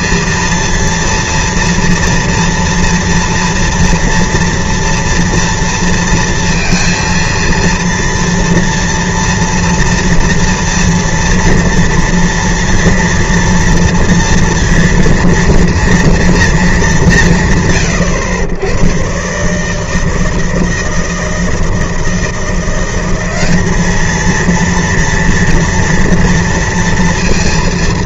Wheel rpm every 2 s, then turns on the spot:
230, 230, 230, 230, 230, 230, 230, 230, 210, 110, 160, 180, 230, 230.
none